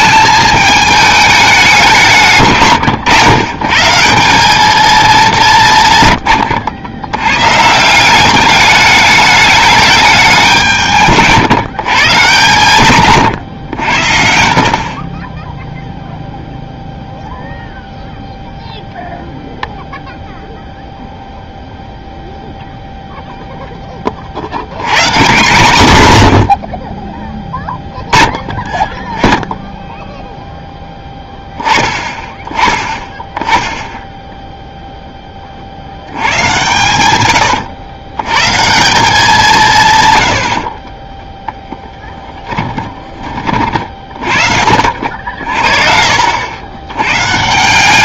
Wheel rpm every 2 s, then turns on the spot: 220, 140, 220, 90, 200, 170, 140, 50, 0, 0, 0, 0, 110, 70, 10, 0, 20, 0, 110, 160, 50, 10, 60, 90.
2-4 14-16 40-44